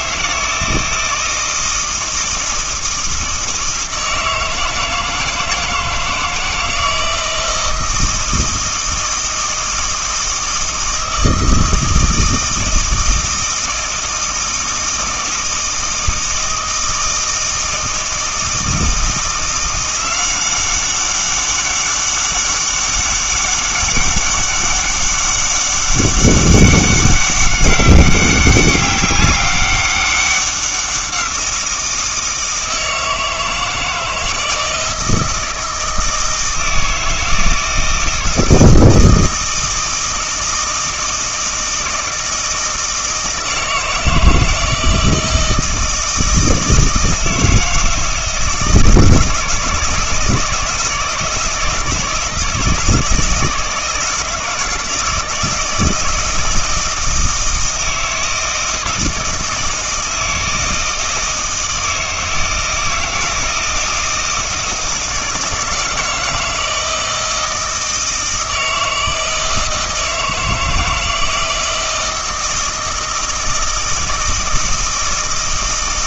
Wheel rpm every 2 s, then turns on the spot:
160, 160, 160, 160, 160, 160, 160, 160, 160, 160, 190, 200, 200, 200, 200, 190, 160, 160, 160, 160, 160, 160, 160, 160, 160, 160, 160, 160, 160, 160, 160, 160, 160, 160, 160, 160, 160, 160.
none